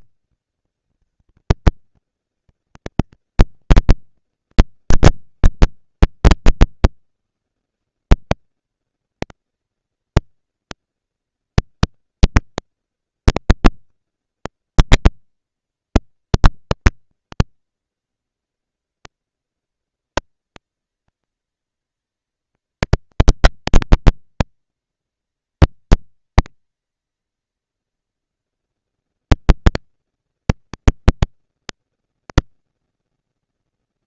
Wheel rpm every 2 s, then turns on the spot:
220, 210, 210, 120, 200, 220, 230, 230, 230, 230, 220, 220, 220, 220, 230, 230, 240.
none